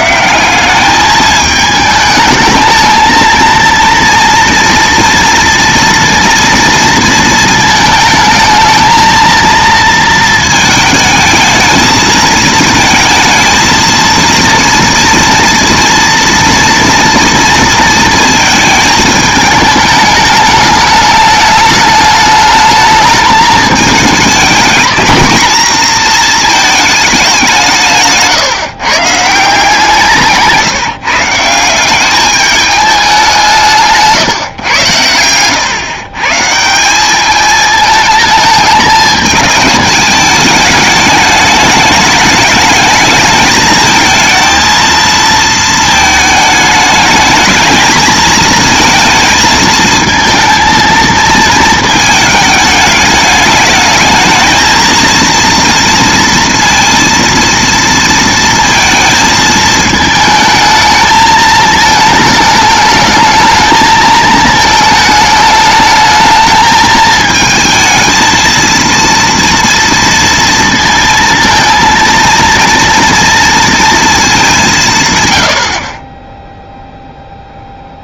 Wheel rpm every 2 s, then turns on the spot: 200, 220, 230, 230, 220, 220, 220, 230, 230, 220, 210, 210, 220, 220, 140, 170, 210, 120, 150, 210, 210, 220, 230, 220, 230, 230, 210, 220, 230, 230, 220, 220, 220, 220, 230, 230, 230, 170, 0.
none